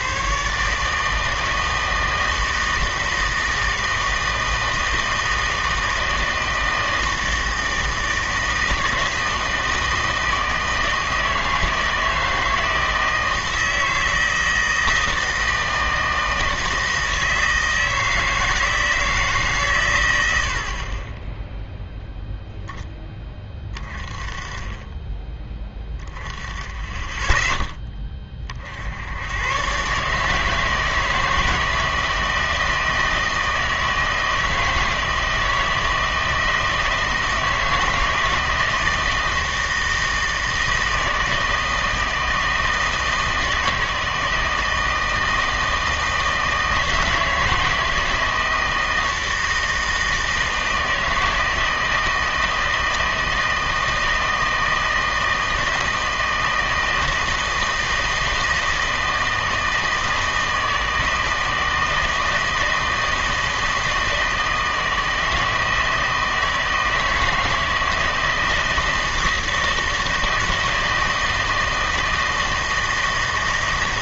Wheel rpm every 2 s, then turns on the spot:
140, 160, 160, 160, 160, 160, 160, 160, 160, 160, 70, 0, 20, 10, 50, 160, 160, 160, 160, 160, 160, 160, 160, 160, 170, 160, 160, 160, 160, 160, 160, 160, 160, 160, 160, 160, 160.
none